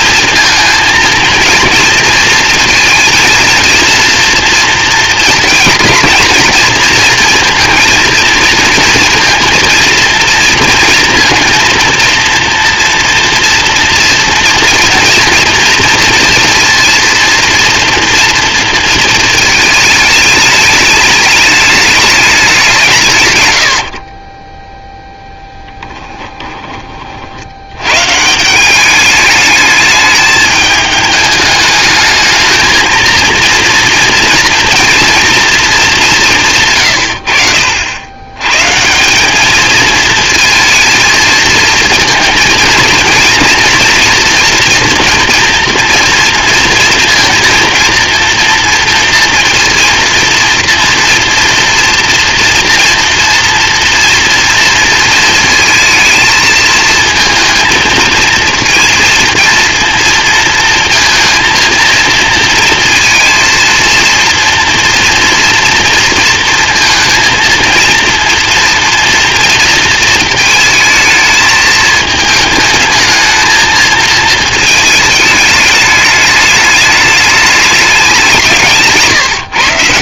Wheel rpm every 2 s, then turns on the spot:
230, 220, 230, 230, 230, 230, 240, 230, 230, 230, 210, 180, 10, 30, 190, 210, 220, 240, 140, 140, 230, 230, 240, 230, 230, 230, 230, 230, 220, 230, 230, 230, 240, 230, 230, 220, 220, 220, 210, 160.
78-80